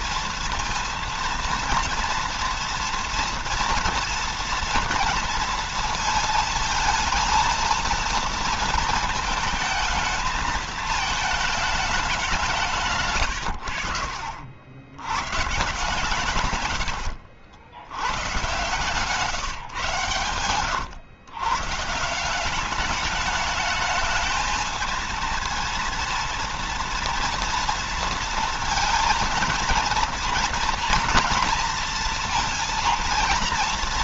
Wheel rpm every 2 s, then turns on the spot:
230, 230, 240, 220, 230, 220, 170, 90, 110, 130, 130, 190, 220, 230, 230, 230, 230.
12-14 18-20